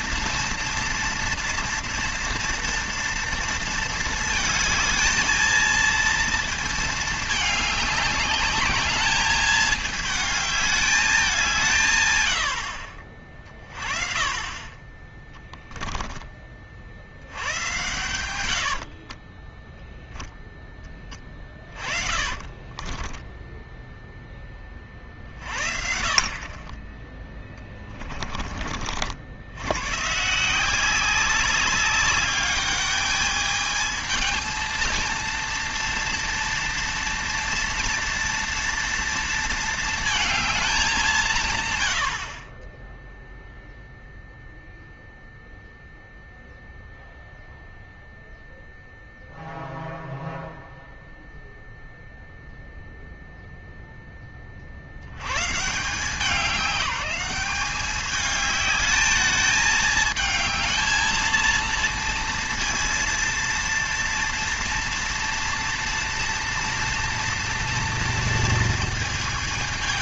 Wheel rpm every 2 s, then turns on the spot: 230, 230, 220, 230, 210, 210, 80, 30, 40, 80, 10, 30, 20, 30, 40, 160, 210, 230, 230, 230, 210, 30, 0, 0, 0, 0, 0, 30, 200, 210, 220, 230, 230, 230, 230.
18-20 22-24